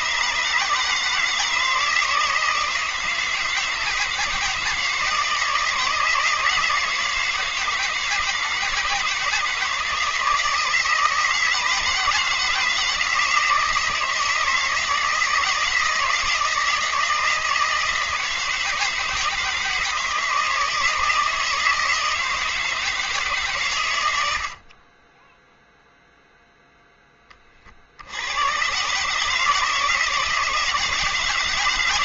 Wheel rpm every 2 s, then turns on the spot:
150, 160, 160, 170, 170, 160, 160, 160, 160, 160, 160, 160, 50, 0, 120, 170.
none